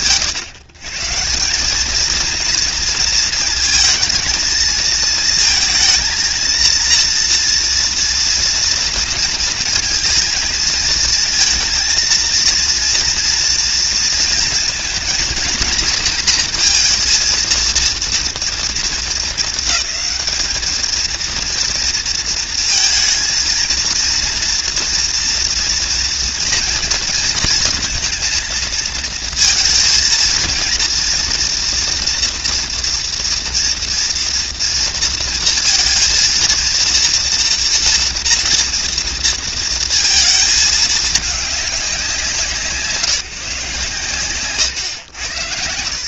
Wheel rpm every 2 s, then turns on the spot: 130, 230, 220, 230, 230, 220, 230, 230, 230, 230, 220, 220, 230, 230, 230, 230, 230, 230, 230, 230, 210, 170, 120.
none